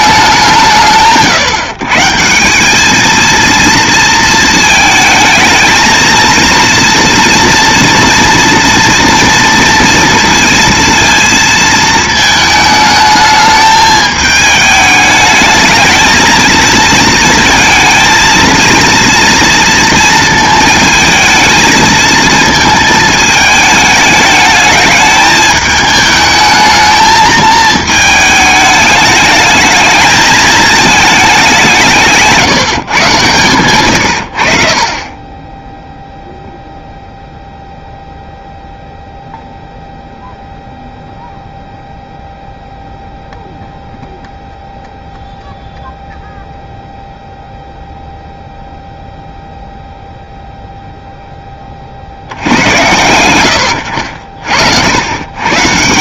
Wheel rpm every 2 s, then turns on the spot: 160, 210, 220, 230, 230, 230, 220, 210, 230, 230, 220, 220, 210, 220, 210, 220, 140, 40, 0, 0, 0, 0, 0, 0, 0, 0, 120, 80.
none